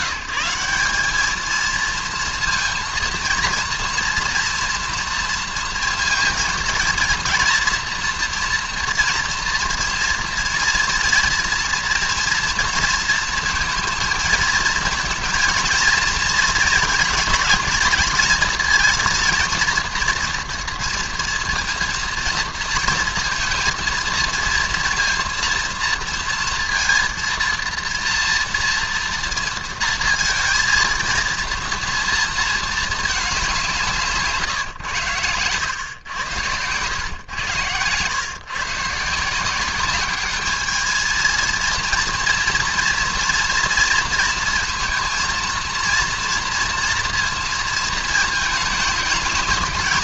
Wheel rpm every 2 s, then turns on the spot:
200, 230, 240, 230, 230, 230, 230, 230, 230, 230, 230, 230, 230, 230, 230, 230, 220, 110, 110, 140, 220, 230, 230, 230, 220.
none